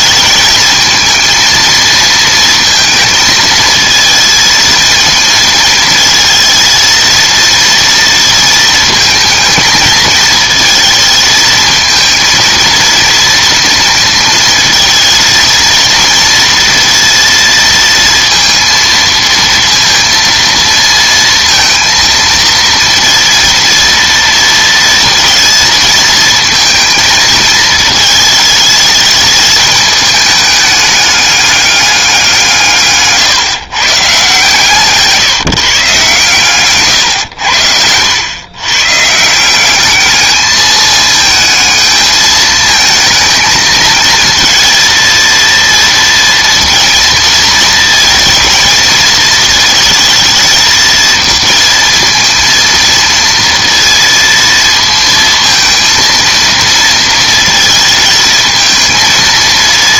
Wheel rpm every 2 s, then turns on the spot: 220, 230, 230, 230, 220, 220, 230, 230, 230, 230, 230, 230, 230, 220, 220, 210, 150, 150, 130, 150, 220, 220, 230, 230, 230, 220, 230, 230, 230, 230.
none